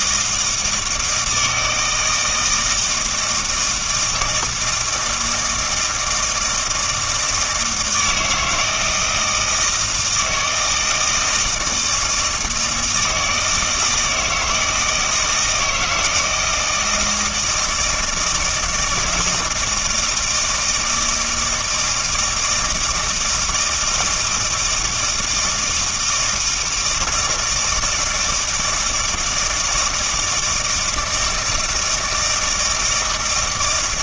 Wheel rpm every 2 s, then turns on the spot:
160, 160, 160, 160, 160, 160, 160, 160, 170, 160, 160, 160, 160, 160, 160, 160, 160.
none